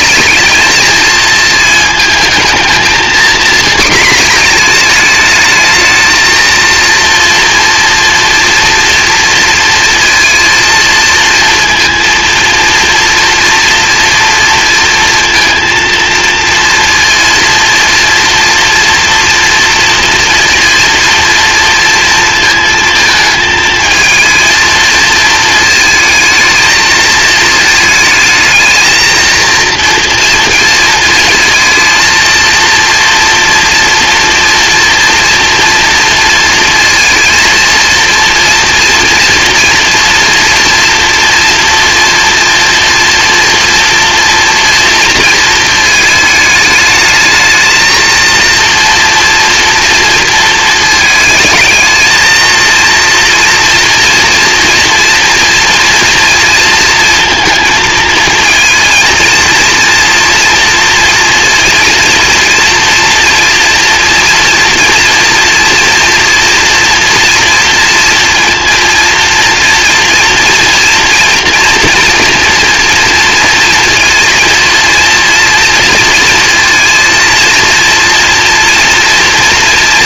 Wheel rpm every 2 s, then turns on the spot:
220, 230, 220, 230, 230, 230, 230, 230, 230, 230, 230, 230, 220, 220, 230, 230, 230, 230, 230, 240, 230, 230, 230, 220, 230, 220, 230, 230, 230, 230, 230, 230, 240, 240, 230, 230, 230, 230, 230, 230.
none